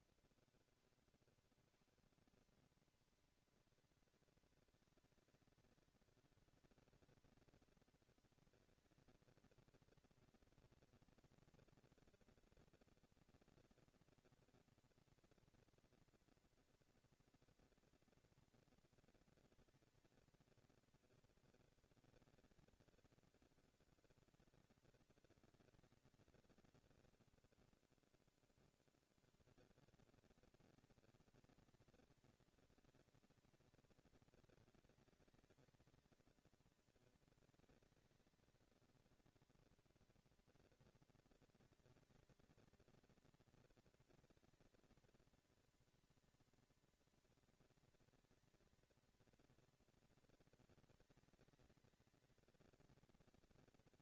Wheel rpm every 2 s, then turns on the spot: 70, 210, 230, 230, 230, 230, 230, 230, 230, 230, 220, 210, 200, 110, 60, 220, 240, 220, 220, 220, 230, 230, 230, 230, 230, 230, 220.
none